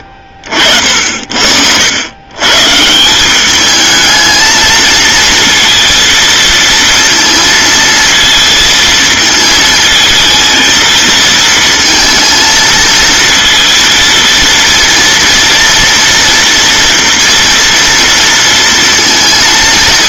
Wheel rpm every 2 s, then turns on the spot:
50, 140, 230, 230, 230, 220, 230, 230, 230, 230.
none